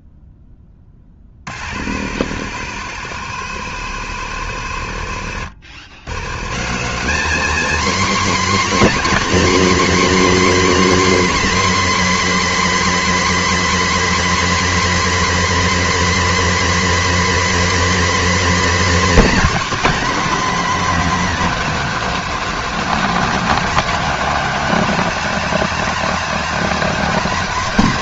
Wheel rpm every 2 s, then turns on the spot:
10, 110, 110, 120, 270, 270, 270, 270, 270, 270, 290, 250, 260, 270.
none